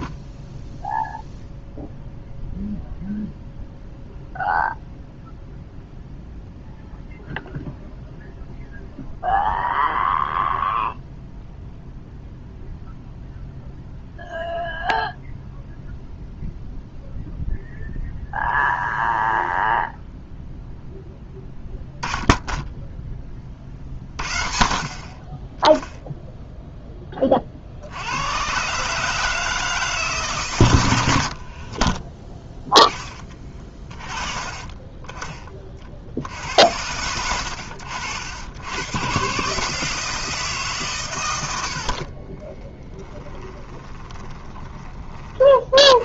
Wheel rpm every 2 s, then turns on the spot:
0, 0, 0, 0, 0, 0, 0, 0, 0, 0, 0, 0, 50, 0, 130, 130, 10, 20, 70, 100, 160, 20, 20.
42-46